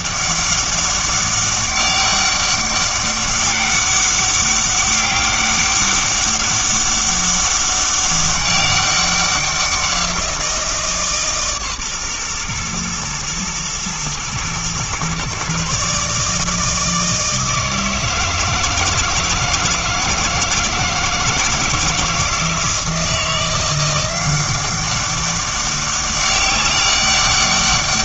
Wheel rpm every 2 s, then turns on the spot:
200, 200, 200, 200, 200, 160, 120, 120, 160, 160, 160, 160, 190, 200.
none